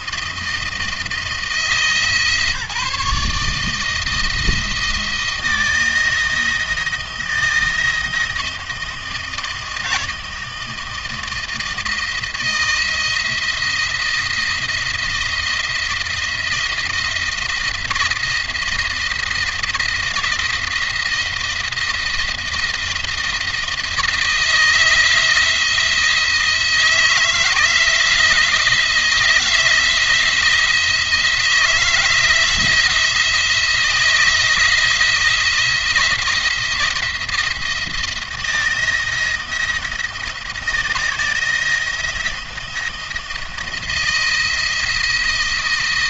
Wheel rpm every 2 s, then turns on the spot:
160, 150, 170, 170, 170, 160, 160, 170, 170, 160, 170, 170, 160, 160, 170, 160, 170, 170, 170, 170, 170, 170, 170.
none